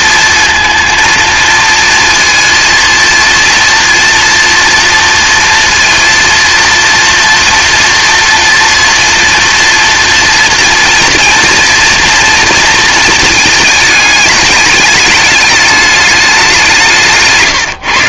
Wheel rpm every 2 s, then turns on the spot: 230, 230, 230, 230, 230, 240, 230, 220, 170.
none